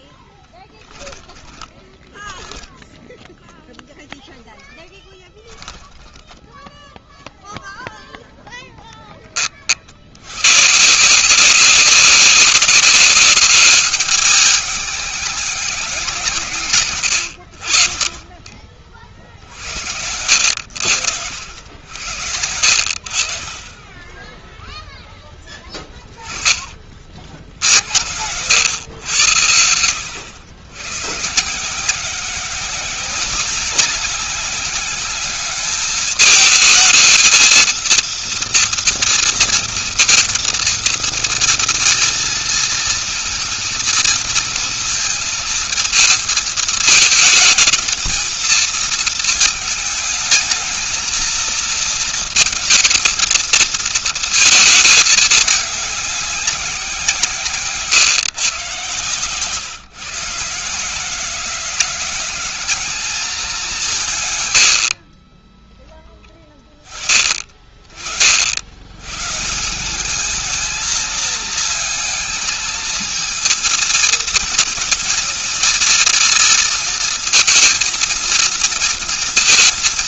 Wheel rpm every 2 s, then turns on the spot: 10, 0, 10, 0, 10, 150, 200, 210, 130, 40, 80, 60, 0, 40, 100, 120, 190, 200, 220, 230, 230, 230, 230, 220, 230, 220, 220, 220, 170, 140, 160, 210, 60, 10, 100, 220, 220, 230, 230, 230.
0-2